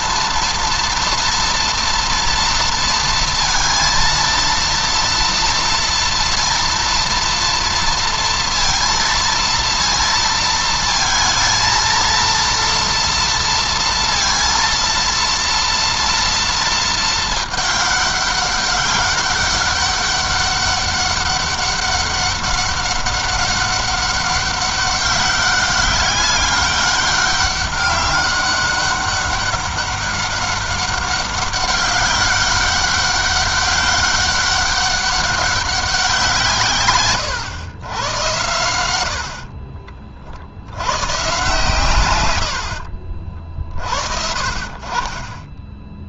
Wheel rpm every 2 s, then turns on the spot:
230, 230, 230, 230, 230, 220, 230, 230, 220, 200, 200, 200, 200, 200, 200, 200, 190, 200, 120, 70, 110, 60, 30.
42-44